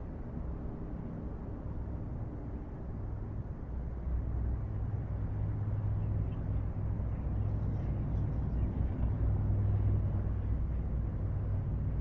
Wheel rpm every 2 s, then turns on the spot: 0, 0, 0, 0, 0, 0.
none